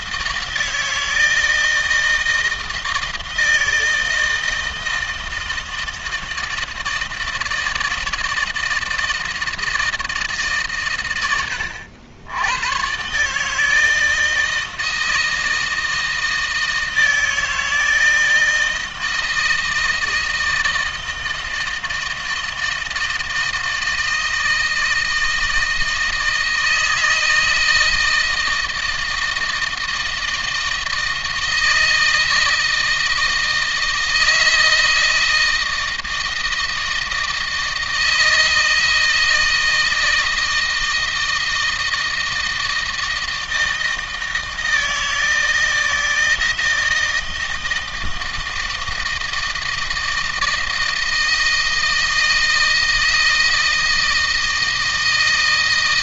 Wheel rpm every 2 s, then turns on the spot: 160, 160, 160, 160, 160, 130, 110, 160, 160, 160, 160, 160, 160, 160, 160, 160, 160, 160, 160, 160, 160, 160, 160, 160, 160, 160, 160, 160.
none